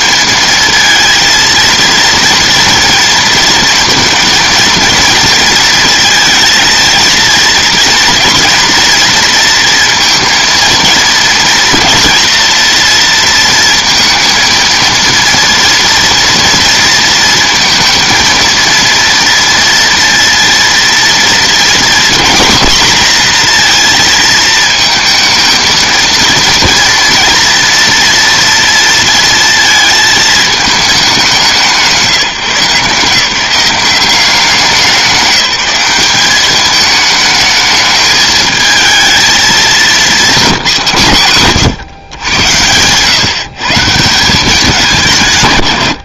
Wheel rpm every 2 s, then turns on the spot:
230, 220, 230, 230, 230, 230, 230, 230, 230, 230, 230, 240, 230, 230, 230, 210, 150, 190, 220, 220, 160, 130, 170.
none